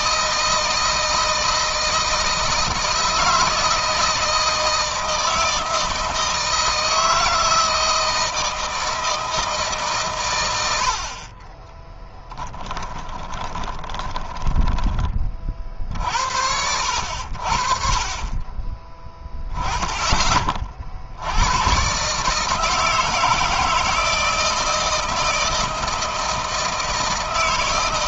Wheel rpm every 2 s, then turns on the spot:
160, 160, 160, 160, 160, 100, 10, 20, 80, 20, 30, 150, 160, 160.
12-14